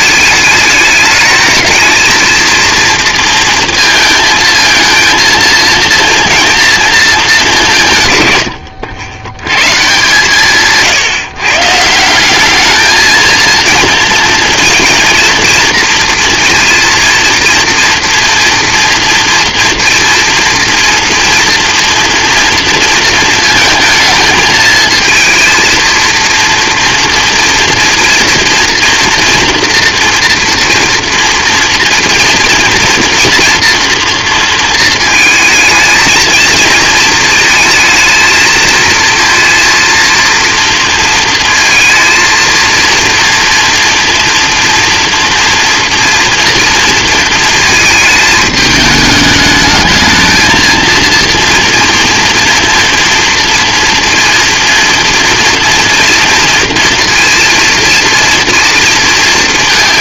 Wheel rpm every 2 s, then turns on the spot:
210, 230, 230, 230, 110, 140, 210, 230, 230, 240, 230, 230, 220, 230, 230, 240, 240, 230, 220, 230, 230, 230, 230, 230, 210, 220, 230, 230, 230, 230.
none